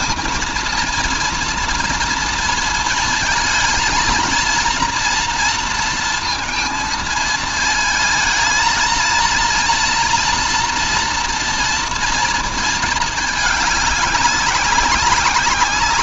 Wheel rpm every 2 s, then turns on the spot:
230, 230, 230, 230, 230, 230, 230, 200.
none